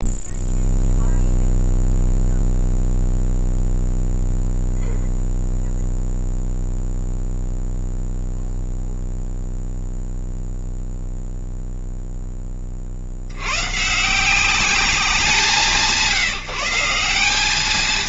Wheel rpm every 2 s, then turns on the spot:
0, 0, 0, 0, 0, 0, 40, 180, 170.
none